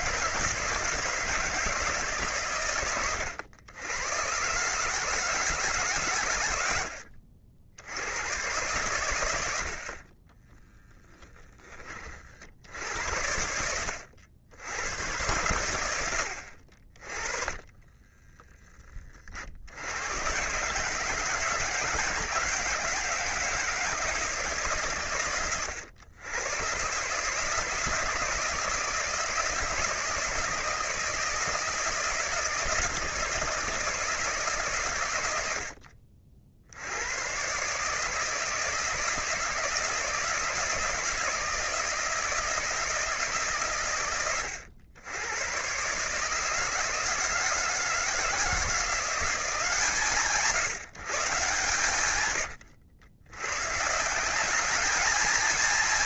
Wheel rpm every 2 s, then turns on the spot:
160, 110, 140, 70, 110, 10, 70, 100, 40, 20, 140, 160, 140, 130, 160, 160, 160, 130, 80, 160, 160, 170, 100, 160, 170, 160, 90, 210.
10-12